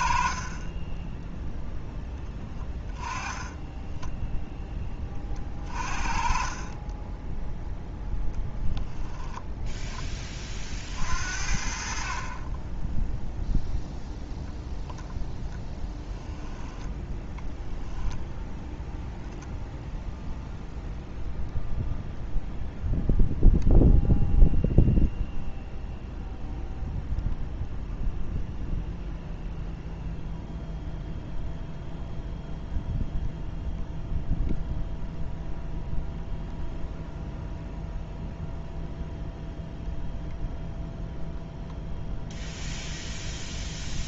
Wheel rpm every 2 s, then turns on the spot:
20, 10, 10, 20, 0, 50, 10, 0, 10, 10, 0, 0, 0, 0, 0, 0, 0, 0, 0, 0, 0, 0.
2-4 6-8 16-18